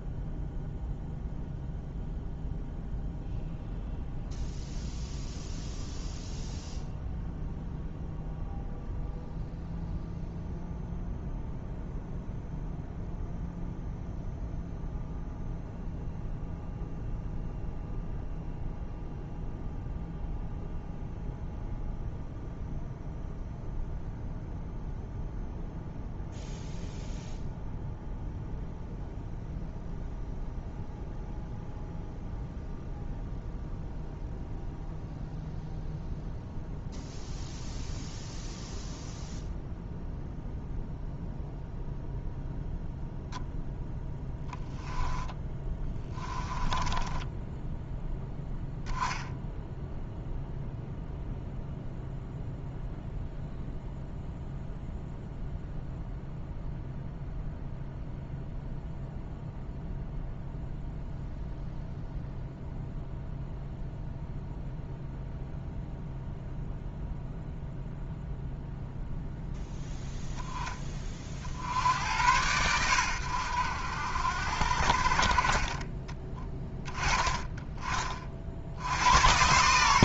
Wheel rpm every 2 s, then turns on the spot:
0, 0, 0, 0, 0, 0, 0, 0, 0, 0, 0, 0, 0, 0, 0, 0, 0, 0, 0, 0, 0, 0, 10, 10, 0, 0, 0, 0, 0, 0, 0, 0, 0, 0, 0, 20, 100, 60, 10, 70.
44-48